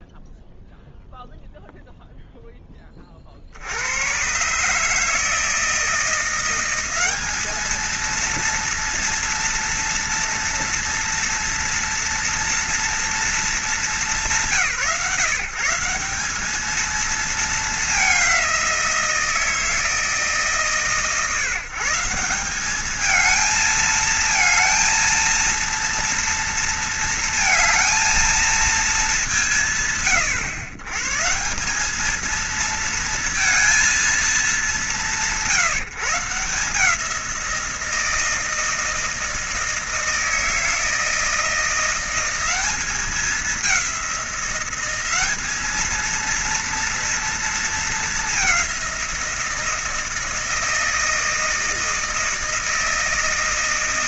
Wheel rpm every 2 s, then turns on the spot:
0, 20, 150, 190, 230, 230, 230, 150, 230, 180, 140, 210, 230, 230, 220, 130, 230, 190, 150, 160, 160, 200, 190, 230, 190, 160, 160.
none